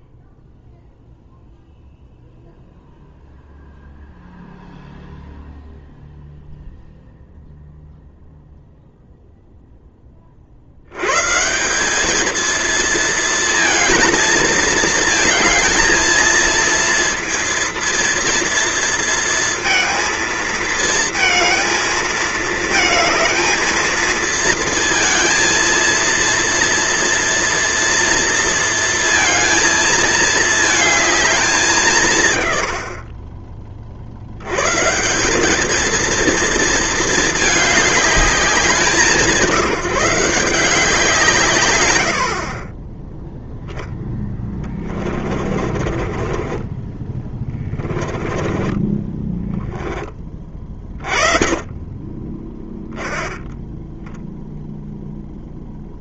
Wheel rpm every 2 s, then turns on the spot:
0, 0, 0, 0, 0, 120, 230, 220, 230, 230, 220, 220, 230, 230, 230, 220, 50, 160, 220, 180, 160, 10, 20, 20, 20, 30, 0, 0.
44-48